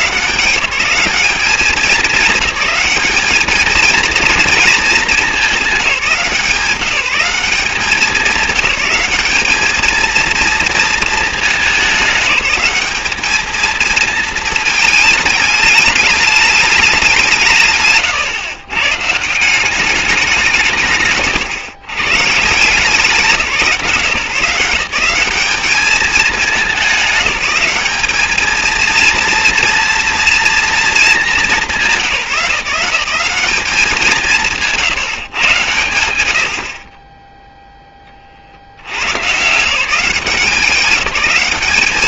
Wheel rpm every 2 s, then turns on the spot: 190, 210, 220, 180, 200, 230, 210, 220, 210, 130, 170, 150, 160, 210, 220, 230, 170, 160, 70, 60, 190.
none